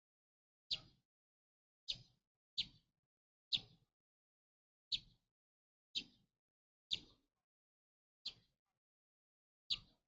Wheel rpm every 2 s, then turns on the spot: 0, 0, 0, 0, 0.
none